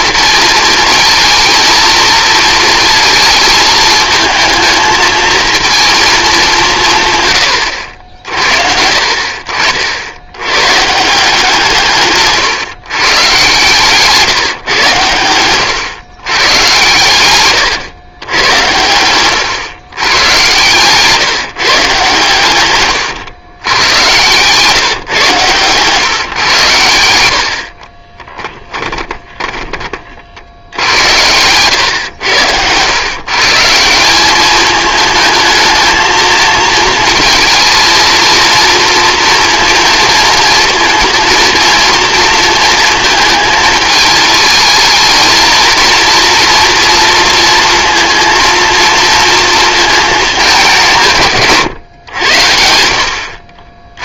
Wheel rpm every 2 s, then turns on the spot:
230, 220, 220, 180, 60, 120, 140, 130, 120, 100, 130, 120, 140, 110, 10, 80, 120, 210, 220, 230, 230, 230, 220, 230, 230, 180, 70.
18-20 28-30